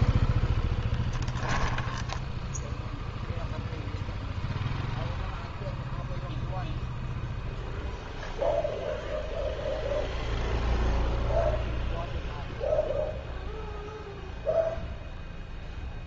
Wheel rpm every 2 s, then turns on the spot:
10, 0, 0, 0, 0, 0, 0, 0.
none